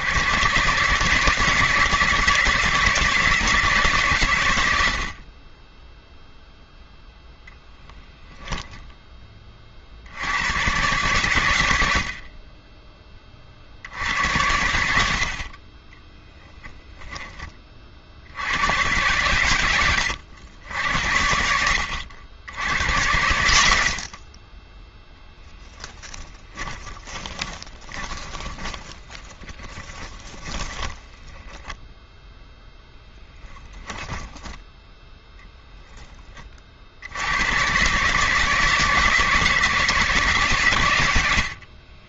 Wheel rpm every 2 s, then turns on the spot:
130, 160, 90, 0, 10, 110, 30, 80, 0, 100, 70, 90, 20, 10, 20, 20, 0, 10, 50, 150, 130.
12-14 26-32